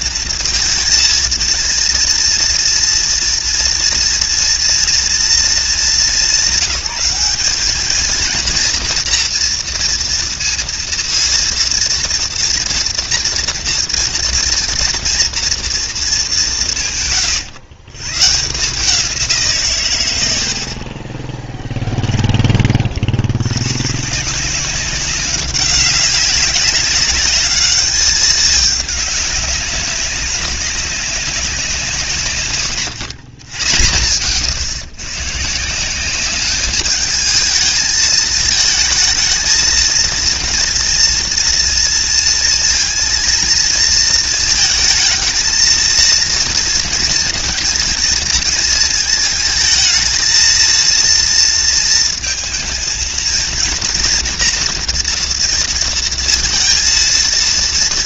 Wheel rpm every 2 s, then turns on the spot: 230, 230, 230, 190, 230, 230, 230, 230, 180, 160, 70, 30, 170, 190, 210, 190, 140, 120, 210, 220, 230, 230, 220, 230, 220, 230, 230, 230, 230.
none